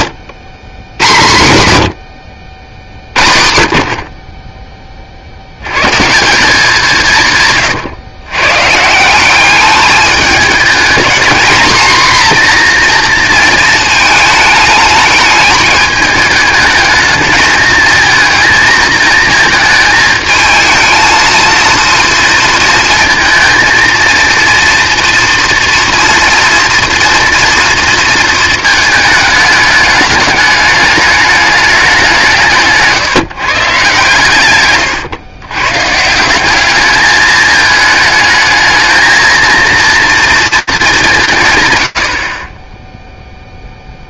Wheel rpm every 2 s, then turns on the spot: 120, 70, 20, 180, 150, 220, 240, 220, 210, 220, 220, 230, 230, 240, 220, 210, 160, 130, 200, 220, 210, 10.
34-36